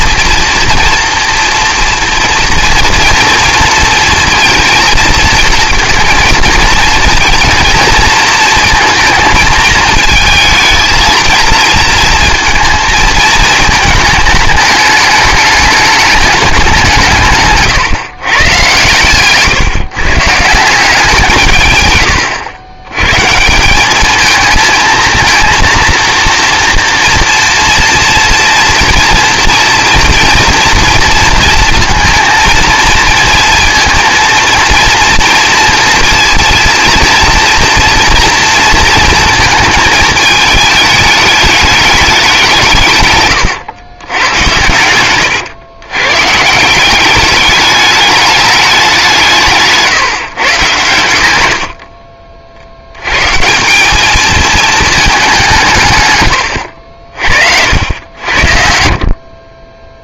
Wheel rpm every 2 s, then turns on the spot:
230, 230, 230, 230, 230, 220, 230, 220, 200, 120, 150, 110, 220, 230, 230, 230, 230, 230, 230, 230, 210, 190, 100, 150, 210, 120, 60, 220, 110, 70.
none